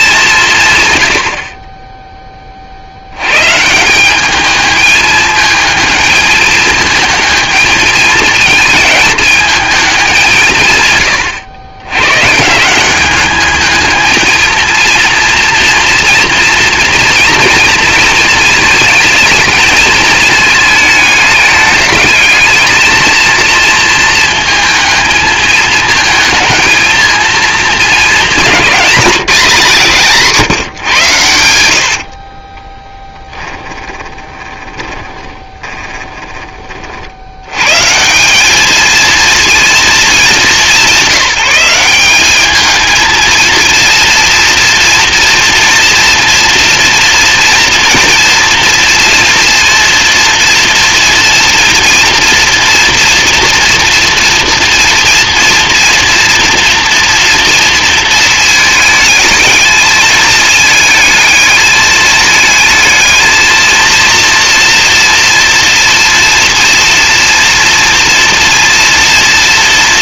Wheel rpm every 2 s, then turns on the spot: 170, 40, 210, 220, 220, 160, 170, 230, 230, 220, 220, 220, 220, 220, 200, 160, 30, 20, 40, 220, 190, 220, 230, 230, 230, 240, 230, 230, 230, 220, 220, 220, 230, 230, 230.
32-36